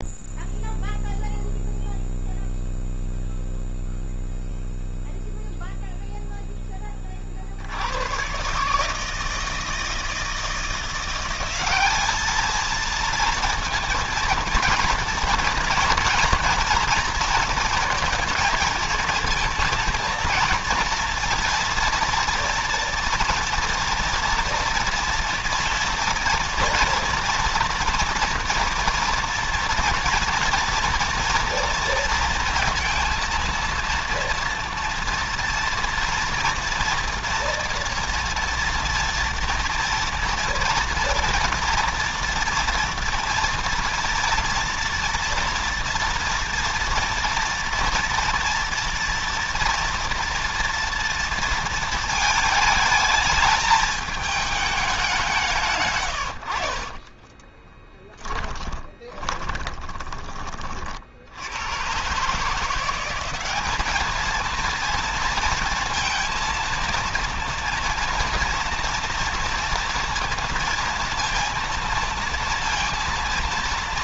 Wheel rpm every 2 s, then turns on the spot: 0, 0, 0, 20, 150, 170, 220, 240, 230, 230, 230, 230, 230, 240, 230, 230, 230, 230, 230, 230, 240, 240, 240, 230, 230, 230, 220, 210, 40, 10, 40, 170, 230, 230, 230, 230, 230.
56-60